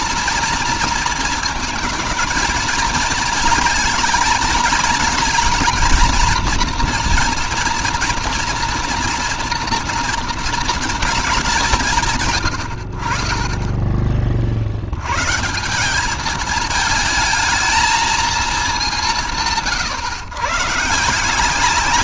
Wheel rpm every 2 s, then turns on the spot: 220, 230, 230, 240, 230, 170, 30, 160, 230, 170, 170.
none